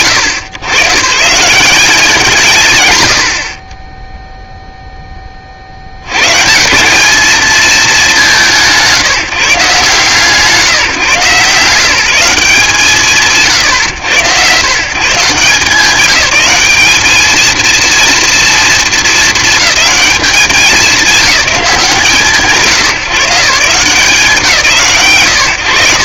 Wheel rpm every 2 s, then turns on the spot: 150, 120, 0, 160, 180, 160, 150, 140, 210, 220, 190, 140, 130.
none